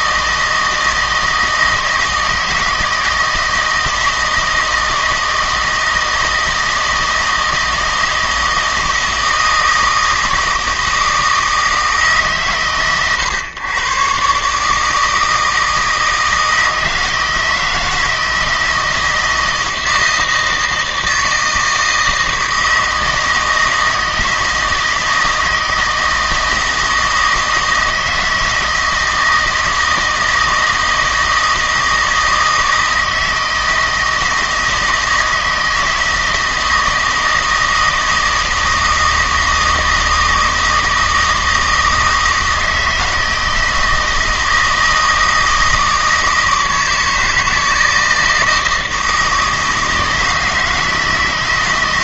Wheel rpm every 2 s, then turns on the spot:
160, 160, 160, 160, 160, 160, 100, 150, 160, 160, 160, 160, 160, 160, 160, 160, 160, 160, 160, 160, 160, 160, 160, 160, 160, 160.
none